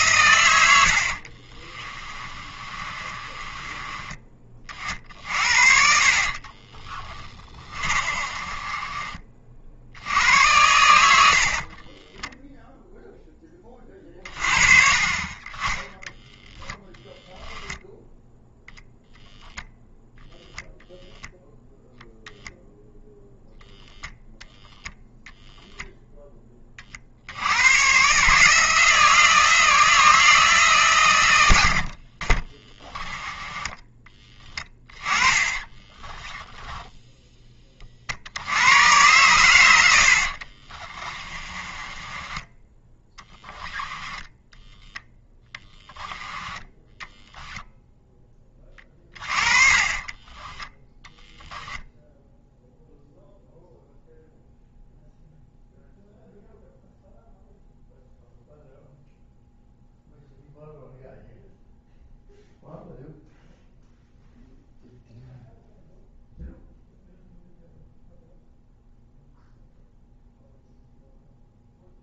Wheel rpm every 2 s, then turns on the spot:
60, 30, 50, 30, 30, 80, 0, 50, 10, 0, 0, 0, 0, 50, 160, 130, 10, 20, 10, 100, 30, 10, 10, 10, 30, 0, 0, 0, 0, 0, 0, 0, 0, 0, 0, 0.
0-10 34-36 40-42 48-50